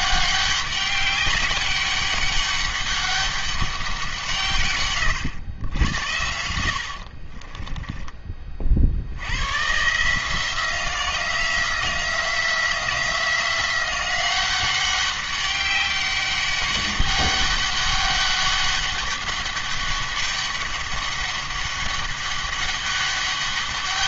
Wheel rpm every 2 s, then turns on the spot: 200, 200, 130, 70, 50, 170, 170, 190, 200, 200, 200, 200.
6-8